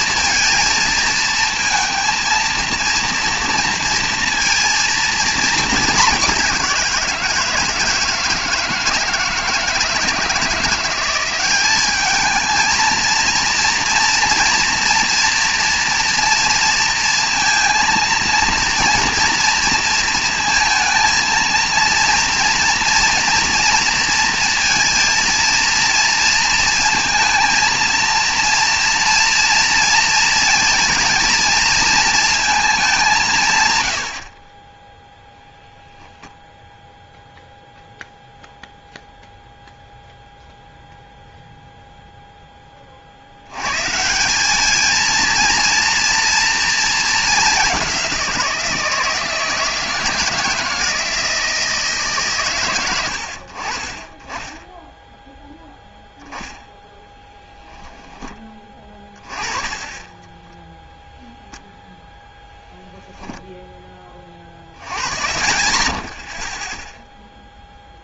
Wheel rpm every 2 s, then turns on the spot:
230, 230, 230, 190, 160, 170, 220, 230, 230, 230, 230, 230, 230, 230, 230, 230, 220, 30, 0, 0, 0, 10, 210, 230, 170, 170, 120, 10, 10, 20, 10, 0, 40, 0.
none